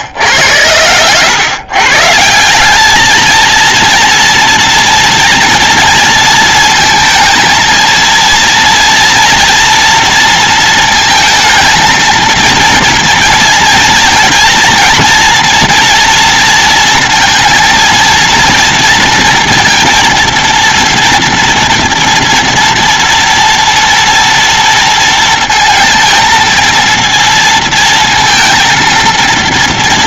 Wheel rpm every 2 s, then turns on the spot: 110, 150, 230, 230, 230, 230, 220, 240, 230, 230, 230, 230, 230, 230, 230.
none